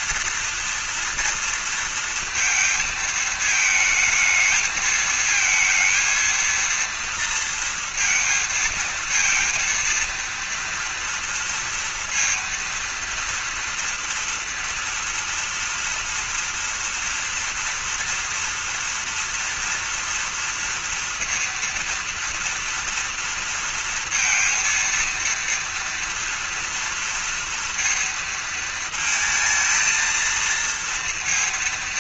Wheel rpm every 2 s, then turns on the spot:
230, 230, 220, 230, 230, 230, 230, 230, 230, 230, 230, 230, 230, 230, 230, 230.
none